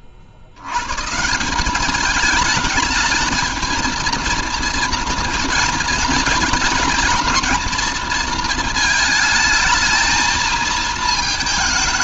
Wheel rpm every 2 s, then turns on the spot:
80, 210, 230, 230, 230, 220.
none